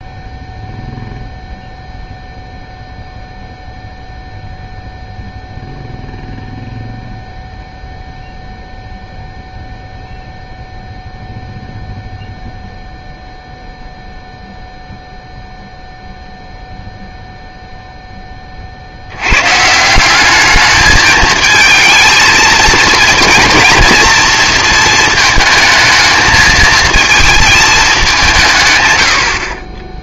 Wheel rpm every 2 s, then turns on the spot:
0, 0, 0, 0, 0, 0, 0, 0, 0, 50, 210, 230, 220, 220, 130.
none